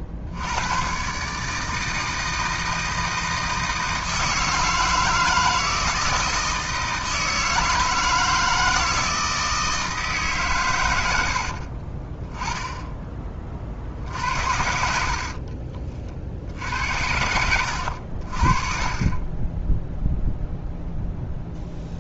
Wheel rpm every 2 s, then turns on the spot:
120, 160, 160, 160, 160, 110, 10, 60, 80, 40, 0.
14-16